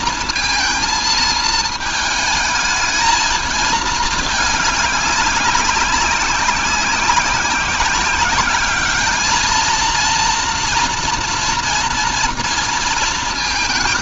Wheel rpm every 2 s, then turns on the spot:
230, 220, 200, 190, 210, 240, 230.
none